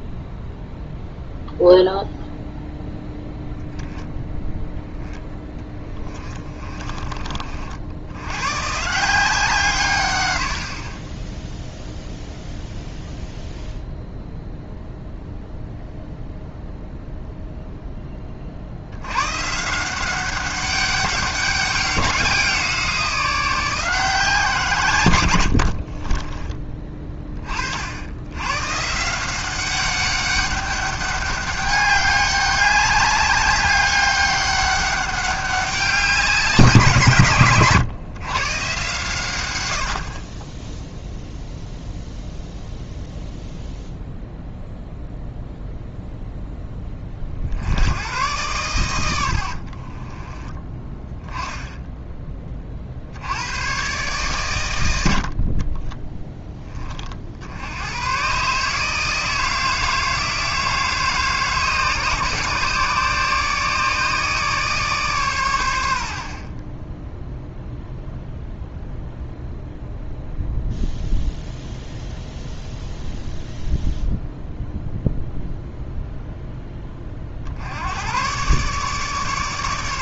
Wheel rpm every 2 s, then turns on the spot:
0, 0, 0, 20, 130, 40, 0, 0, 0, 60, 200, 180, 160, 20, 130, 200, 200, 200, 190, 130, 10, 0, 0, 10, 110, 20, 30, 100, 20, 140, 160, 150, 150, 30, 0, 0, 0, 0, 10, 130.
26-28 50-52